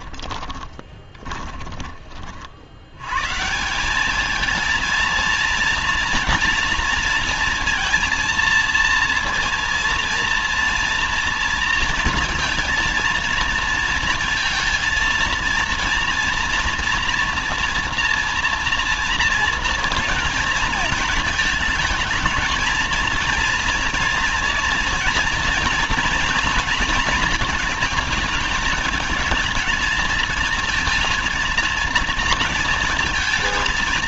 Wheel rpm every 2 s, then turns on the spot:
10, 60, 220, 230, 230, 230, 230, 230, 240, 230, 230, 220, 240, 230, 220, 230, 230.
0-2